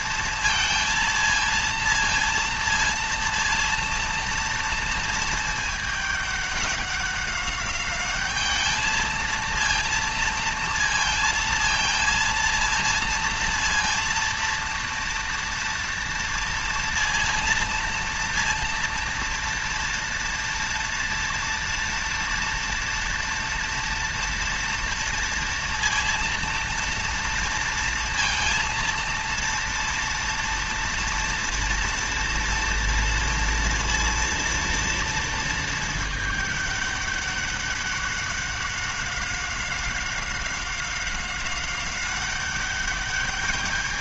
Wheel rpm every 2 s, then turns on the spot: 230, 230, 230, 200, 220, 230, 230, 230, 230, 230, 230, 230, 230, 230, 230, 240, 240, 230, 210, 190, 190, 200.
none